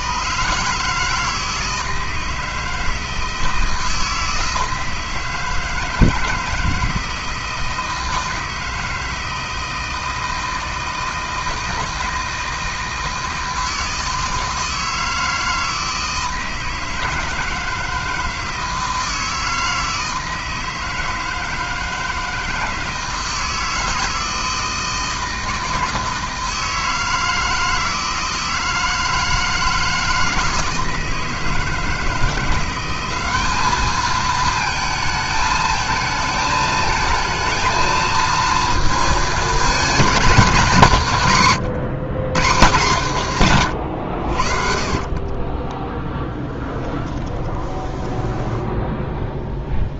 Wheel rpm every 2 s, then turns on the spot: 140, 160, 160, 160, 160, 160, 160, 160, 160, 160, 160, 160, 160, 160, 160, 160, 180, 220, 220, 230, 200, 160, 60, 10, 10.
44-48